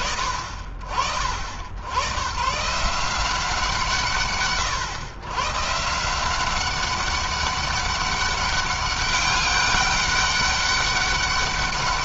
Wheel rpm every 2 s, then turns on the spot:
50, 150, 130, 190, 200, 200.
none